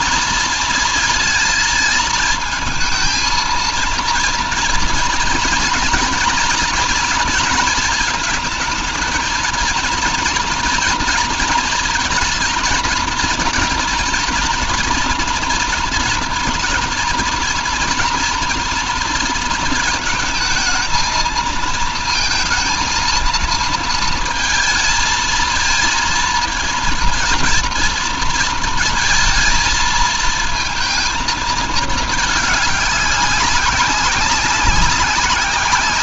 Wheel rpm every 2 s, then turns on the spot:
230, 220, 230, 230, 220, 230, 230, 230, 230, 230, 220, 230, 220, 230, 230, 230, 210, 200.
none